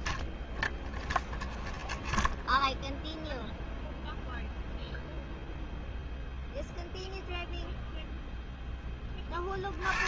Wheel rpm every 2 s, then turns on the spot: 10, 0, 0, 0, 70.
none